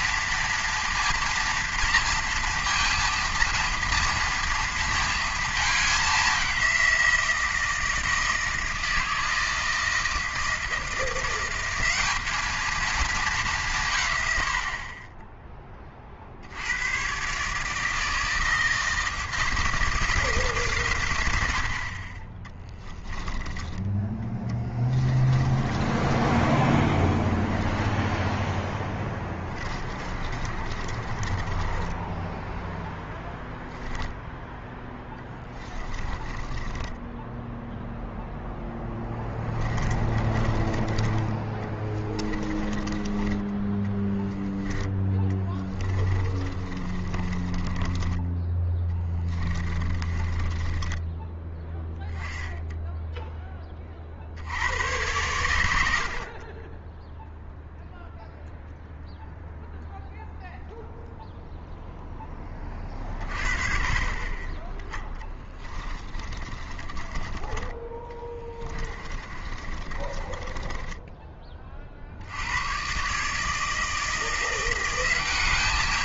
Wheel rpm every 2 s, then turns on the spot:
230, 230, 230, 190, 160, 160, 210, 90, 90, 160, 140, 20, 10, 10, 10, 30, 10, 10, 10, 0, 20, 20, 10, 40, 10, 20, 10, 90, 30, 0, 0, 20, 20, 30, 20, 20, 100, 180.
24-26 30-32 36-38 40-44 46-48 50-52 66-72